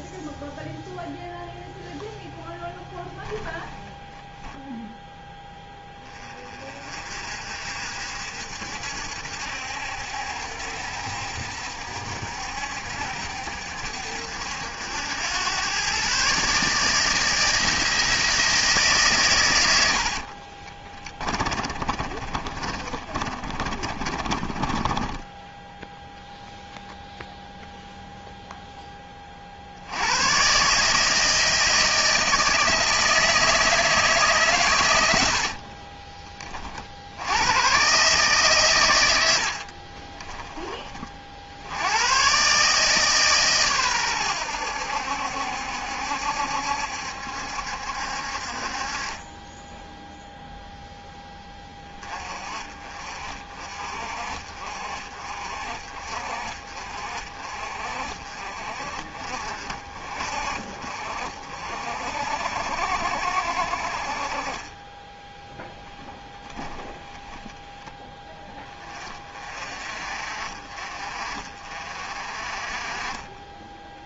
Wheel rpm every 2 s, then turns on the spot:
0, 0, 0, 30, 70, 60, 70, 70, 150, 160, 50, 30, 20, 0, 0, 130, 160, 130, 40, 130, 20, 140, 90, 70, 50, 0, 30, 50, 50, 40, 50, 60, 30, 10, 20, 40, 40.
20-26 64-66